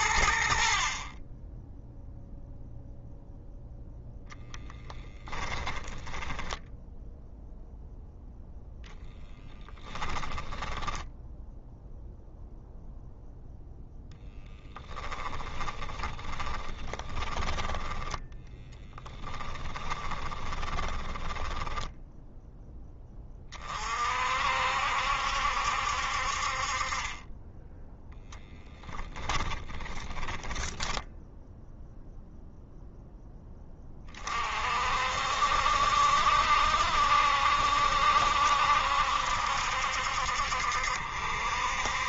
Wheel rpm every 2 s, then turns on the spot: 60, 0, 20, 10, 0, 0, 0, 20, 20, 10, 20, 10, 60, 30, 10, 10, 0, 50, 70, 70, 60.
4-6 14-22